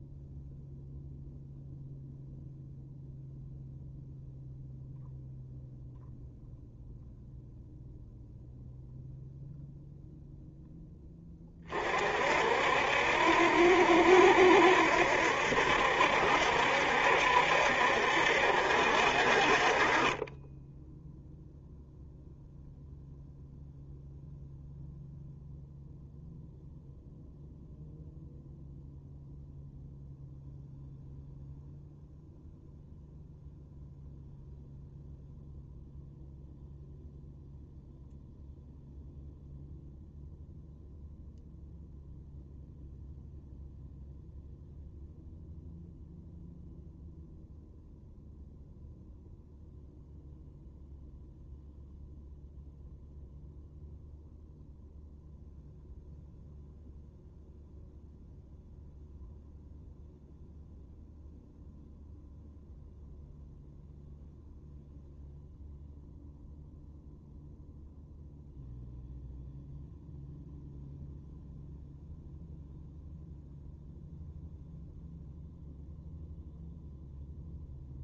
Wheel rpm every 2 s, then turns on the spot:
0, 0, 0, 0, 0, 0, 60, 70, 70, 60, 10, 0, 0, 0, 0, 0, 0, 0, 0, 0, 0, 0, 0, 0, 0, 0, 0, 0, 0, 0, 0, 0, 0, 0, 0, 0, 0, 0, 0.
none